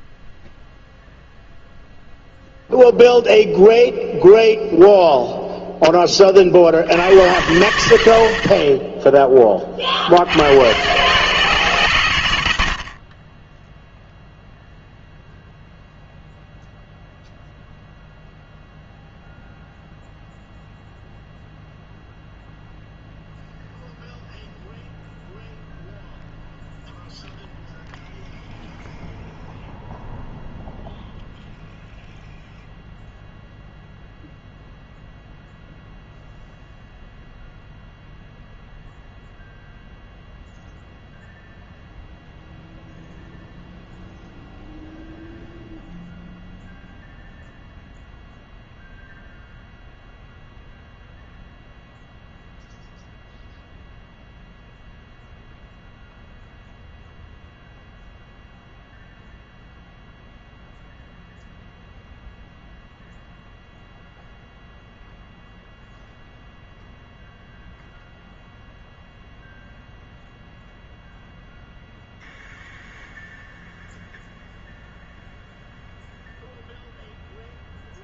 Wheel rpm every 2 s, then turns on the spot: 0, 0, 0, 70, 40, 120, 50, 0, 0, 0, 0, 0, 0, 0, 0, 0, 0, 0, 0, 0, 0, 0, 0, 0, 0, 0, 0, 0, 0, 0, 0, 0, 0, 0, 0, 0, 0, 0, 0.
none